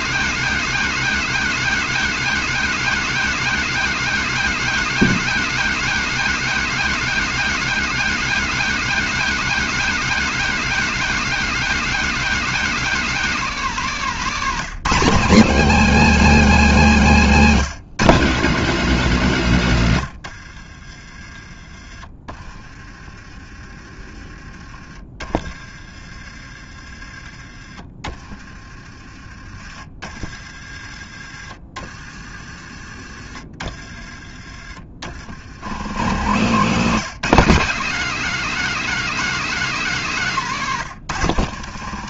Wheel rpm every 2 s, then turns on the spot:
250, 250, 250, 250, 260, 250, 250, 210, 200, 190, 40, 30, 30, 30, 30, 40, 40, 50, 160, 220, 150.
20-22